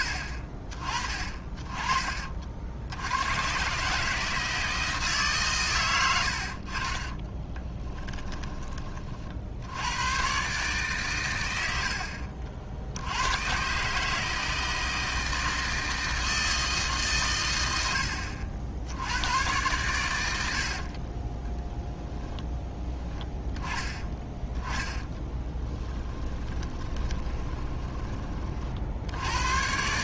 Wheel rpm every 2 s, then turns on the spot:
30, 80, 150, 30, 40, 130, 70, 160, 150, 80, 50, 10, 20, 20, 60.
20-22 24-28